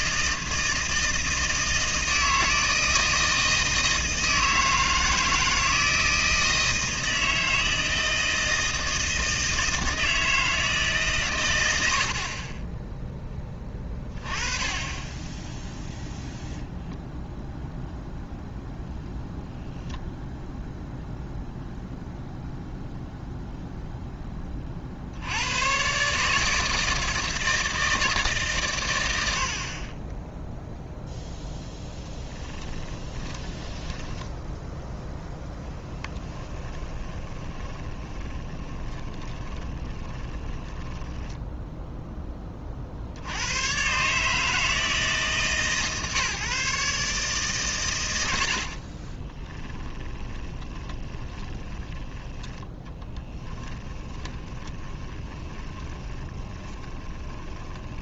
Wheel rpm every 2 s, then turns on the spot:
160, 160, 160, 160, 160, 150, 10, 20, 0, 0, 0, 0, 30, 160, 110, 0, 20, 0, 20, 20, 10, 50, 150, 150, 50, 10, 10, 20, 20.
32-34 36-42 48-58